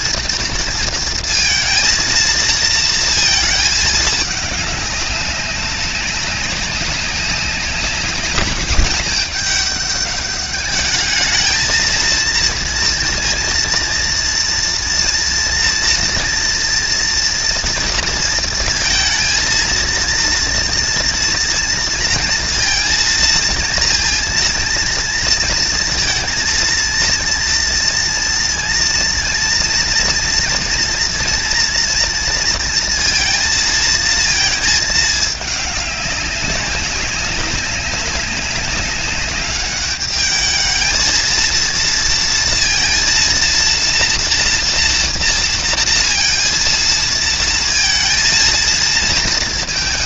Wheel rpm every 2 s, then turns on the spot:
230, 230, 200, 190, 210, 210, 230, 230, 230, 230, 230, 230, 230, 230, 230, 230, 230, 220, 200, 200, 220, 230, 230, 230, 230.
none